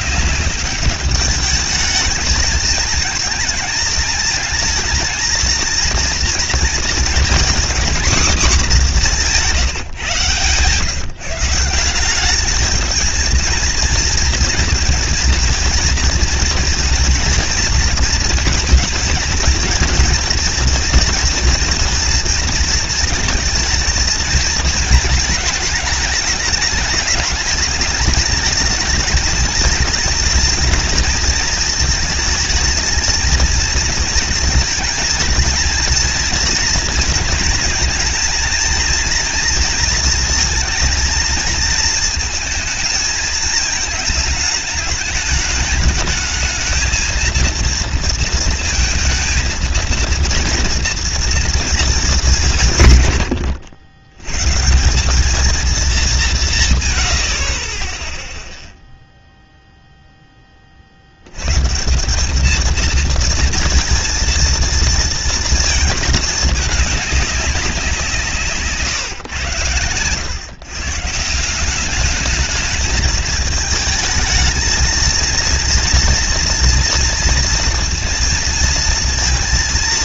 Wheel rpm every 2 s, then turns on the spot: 200, 220, 220, 230, 230, 130, 200, 230, 230, 230, 230, 230, 220, 210, 220, 230, 220, 230, 230, 230, 230, 220, 220, 220, 230, 230, 170, 130, 170, 0, 20, 210, 230, 220, 140, 120, 210, 220, 240, 230.
none